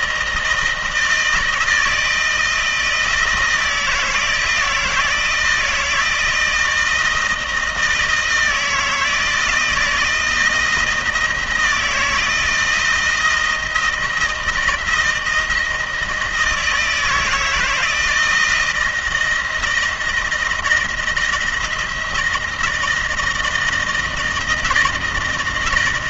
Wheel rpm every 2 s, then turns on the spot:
160, 160, 160, 160, 160, 160, 160, 160, 160, 160, 170, 160, 160.
none